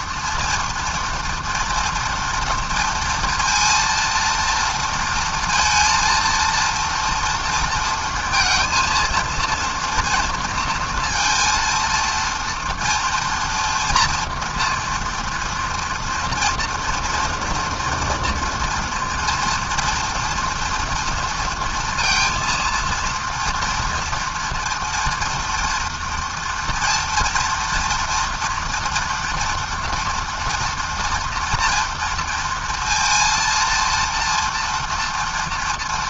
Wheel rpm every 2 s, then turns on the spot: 230, 230, 230, 230, 230, 230, 230, 240, 230, 230, 230, 230, 230, 240, 240, 230, 230, 200.
none